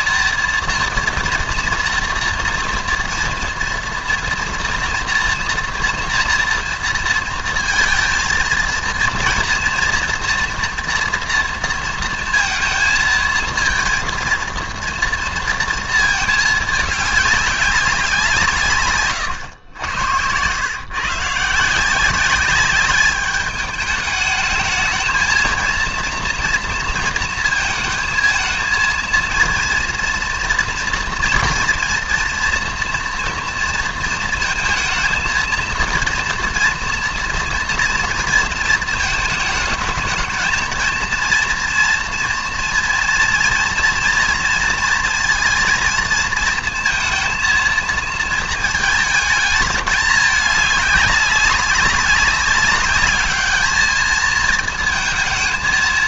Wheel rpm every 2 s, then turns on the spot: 230, 230, 230, 230, 230, 240, 230, 230, 220, 150, 110, 200, 220, 230, 230, 240, 240, 230, 230, 220, 220, 230, 230, 230, 220, 200, 200, 220.
none